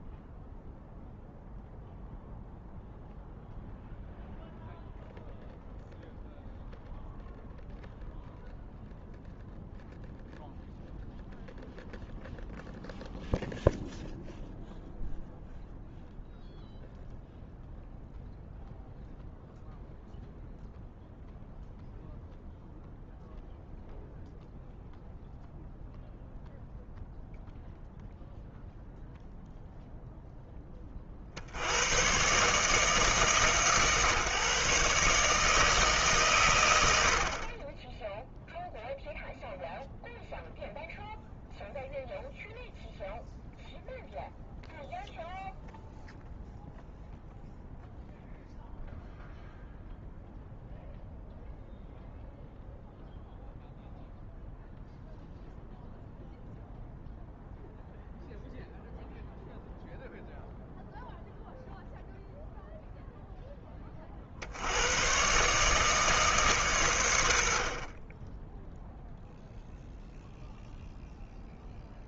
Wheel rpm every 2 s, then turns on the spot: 0, 0, 0, 0, 0, 0, 0, 0, 0, 0, 0, 0, 0, 0, 0, 40, 140, 150, 80, 0, 0, 0, 0, 0, 0, 0, 0, 0, 0, 0, 0, 0, 110, 110, 0, 0.
none